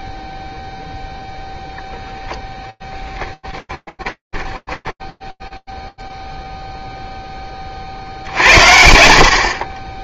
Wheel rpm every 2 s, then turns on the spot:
0, 0, 20, 0, 90.
4-6